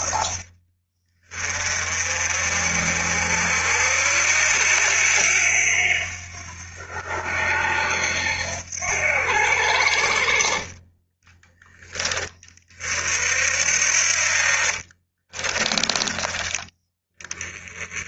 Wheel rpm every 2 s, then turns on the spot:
40, 50, 90, 90, 90, 20, 40, 40, 10.
10-12 14-16